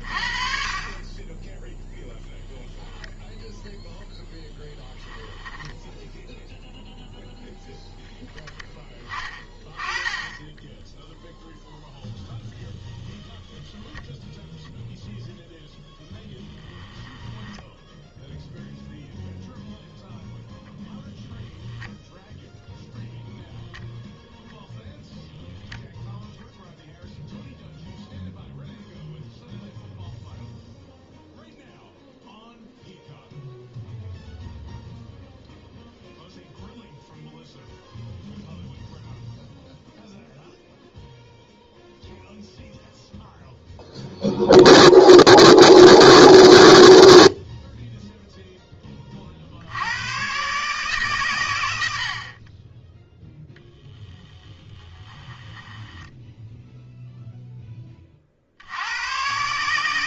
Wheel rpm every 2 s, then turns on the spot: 40, 10, 10, 0, 10, 10, 20, 0, 10, 0, 10, 0, 0, 0, 0, 0, 0, 0, 0, 0, 0, 0, 0, 0, 10, 140, 10, 10, 0, 80.
4-6 10-14 20-22 54-56